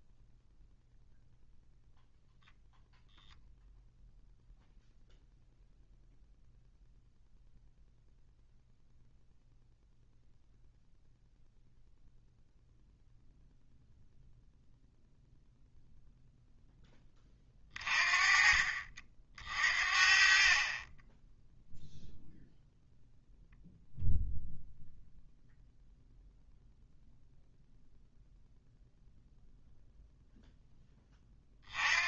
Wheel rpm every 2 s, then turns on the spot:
0, 0, 0, 0, 0, 0, 0, 0, 10, 40, 30, 0, 0, 0, 0, 10.
none